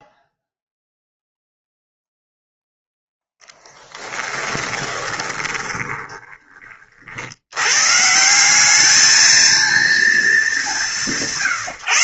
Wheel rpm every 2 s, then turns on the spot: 0, 0, 10, 60, 210, 180.
4-6